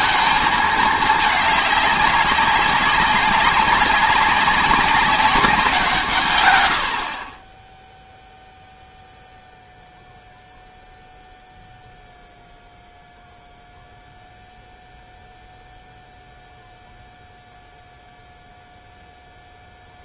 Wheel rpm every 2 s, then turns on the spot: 220, 200, 200, 110, 0, 0, 0, 0, 0, 0.
none